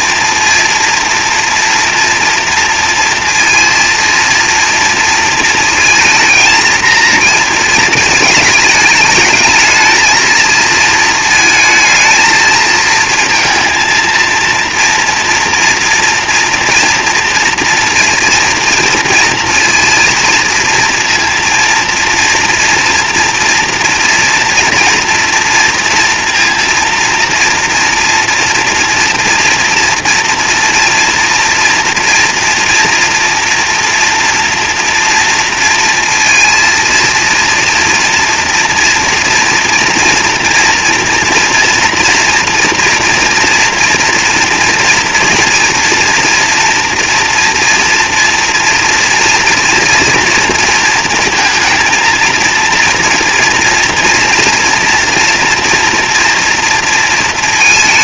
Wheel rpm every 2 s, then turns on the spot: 230, 230, 230, 230, 220, 220, 220, 230, 240, 230, 230, 240, 230, 230, 230, 240, 230, 240, 230, 230, 230, 240, 230, 240, 240, 230, 230, 230, 230.
none